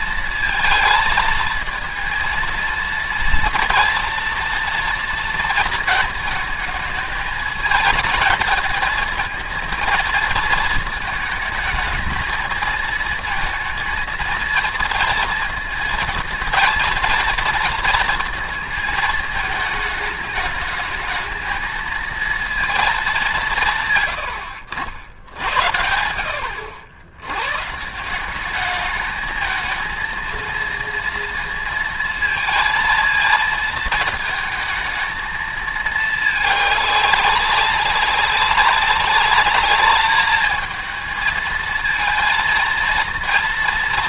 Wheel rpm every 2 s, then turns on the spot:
230, 230, 230, 220, 220, 230, 220, 230, 230, 230, 210, 220, 80, 70, 200, 230, 230, 220, 210, 190, 220, 230.
none